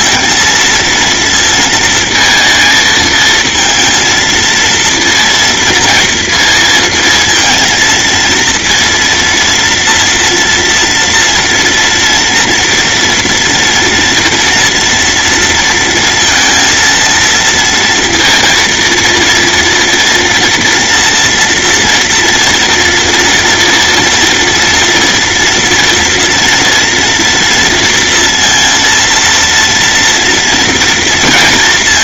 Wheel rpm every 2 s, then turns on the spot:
230, 220, 230, 230, 230, 230, 230, 230, 230, 230, 240, 230, 230, 230, 230, 230.
none